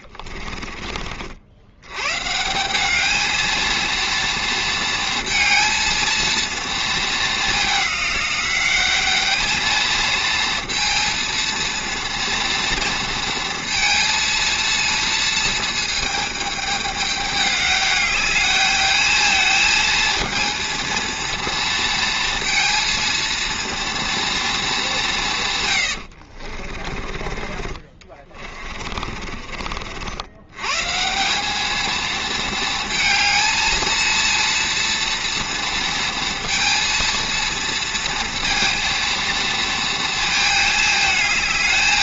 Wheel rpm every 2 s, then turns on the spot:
40, 180, 230, 220, 200, 230, 230, 220, 210, 210, 230, 230, 210, 40, 30, 120, 220, 230, 230, 230, 220.
0-2 26-30